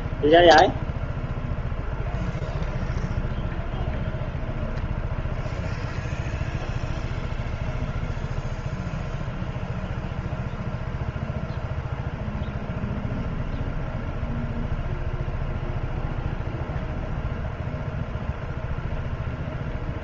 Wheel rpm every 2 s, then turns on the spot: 0, 0, 0, 0, 0, 0, 0, 0, 0, 0.
none